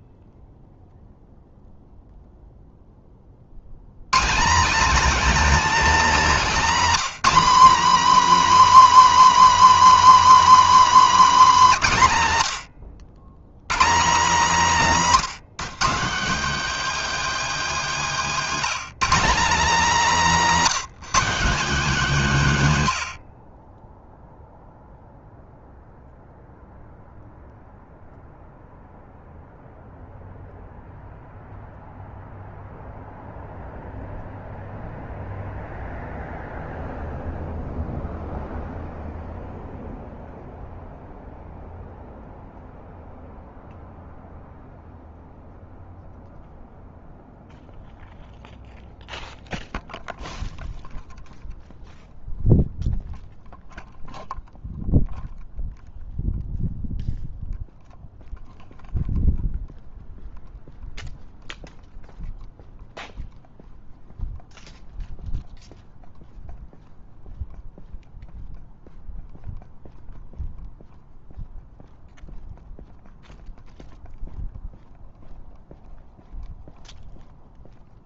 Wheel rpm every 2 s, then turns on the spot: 20, 0, 210, 250, 300, 300, 110, 210, 220, 200, 210, 150, 0, 0, 0, 0, 0, 0, 0, 0, 0, 0, 0, 0, 0, 0, 0, 0, 0, 0, 0, 0, 0, 0, 0, 0, 0, 0, 0.
none